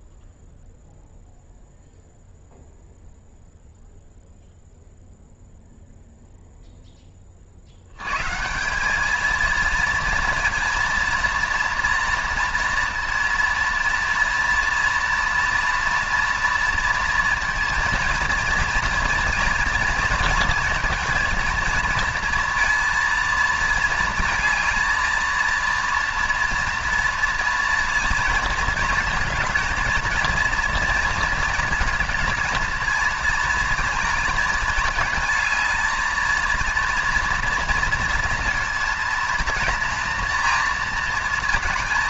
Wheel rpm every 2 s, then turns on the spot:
0, 0, 0, 10, 200, 230, 230, 230, 230, 230, 230, 230, 230, 230, 230, 230, 230, 220, 230, 230, 230.
none